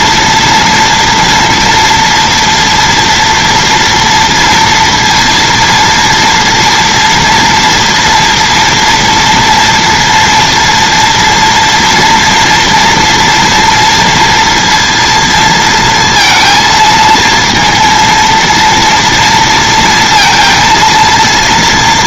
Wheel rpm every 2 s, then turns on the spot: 230, 240, 230, 230, 230, 230, 230, 230, 230, 230, 230.
none